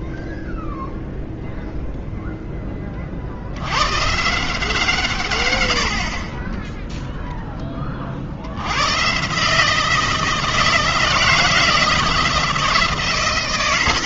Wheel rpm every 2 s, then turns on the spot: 0, 10, 170, 10, 100, 160, 160.
none